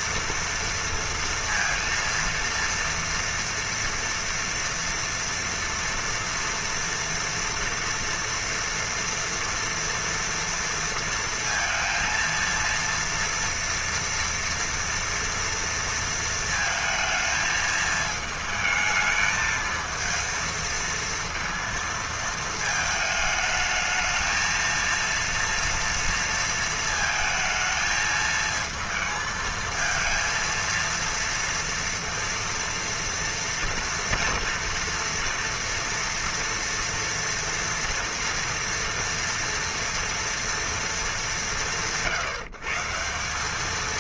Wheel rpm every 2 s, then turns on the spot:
230, 240, 230, 240, 230, 230, 230, 230, 220, 220, 230, 220, 230, 220, 220, 230, 230, 230, 240, 230, 180, 180.
none